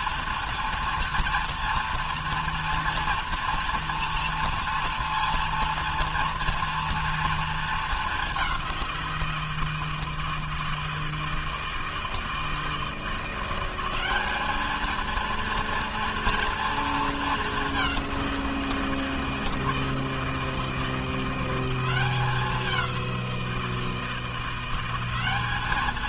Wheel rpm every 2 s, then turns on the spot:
230, 230, 230, 230, 180, 160, 170, 220, 230, 170, 170, 190, 190.
none